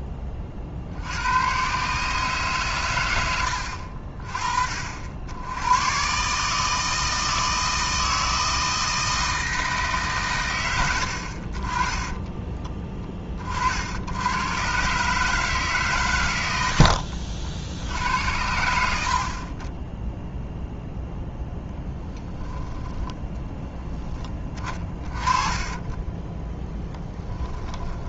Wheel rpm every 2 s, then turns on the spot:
30, 120, 50, 160, 160, 100, 10, 130, 90, 70, 0, 10, 30, 10.
16-18 22-24